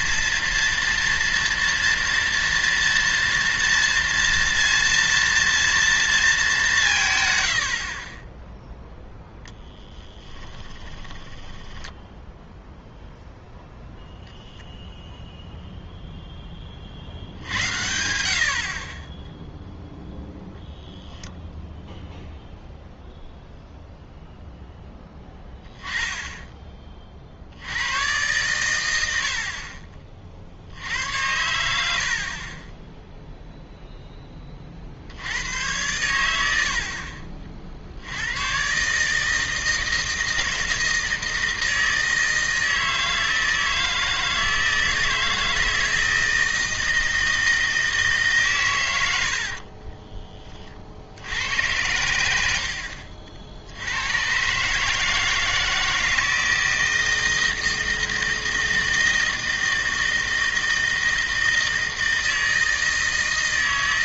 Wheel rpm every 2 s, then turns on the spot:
230, 230, 230, 190, 0, 10, 0, 0, 40, 40, 0, 0, 10, 20, 120, 70, 20, 30, 70, 130, 160, 160, 160, 160, 120, 30, 70, 140, 160, 160, 160, 160.
10-12